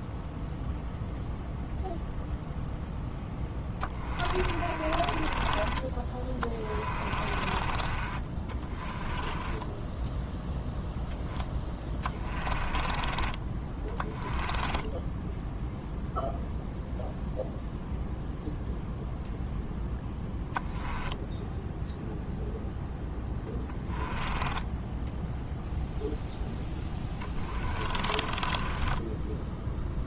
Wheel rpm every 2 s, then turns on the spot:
0, 0, 40, 30, 30, 0, 20, 10, 0, 0, 0, 0, 10, 10, 20.
4-10 12-16 24-30